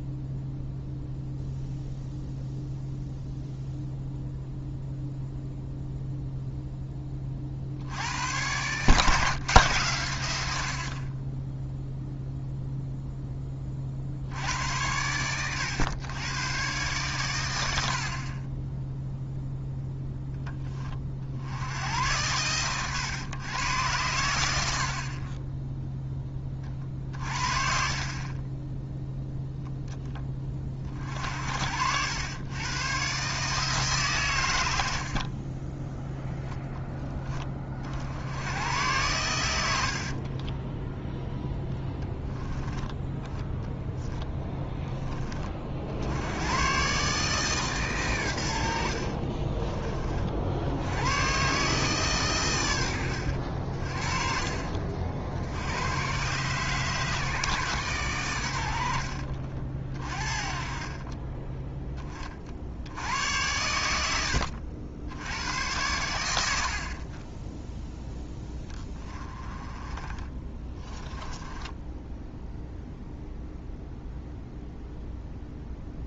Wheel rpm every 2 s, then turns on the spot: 0, 0, 0, 0, 120, 70, 0, 90, 120, 20, 10, 110, 80, 30, 20, 30, 110, 90, 0, 100, 20, 10, 10, 110, 80, 70, 110, 50, 140, 80, 30, 60, 80, 70, 10, 30, 0, 0.
70-72